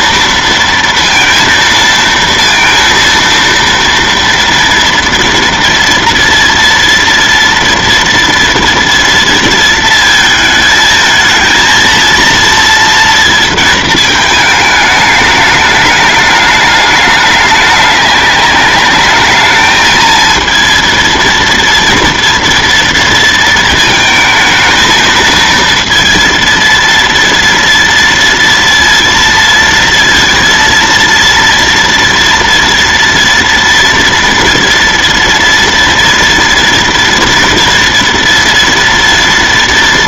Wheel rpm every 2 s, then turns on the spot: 230, 230, 230, 230, 230, 220, 230, 210, 210, 210, 230, 230, 220, 230, 230, 230, 230, 230, 240, 230.
none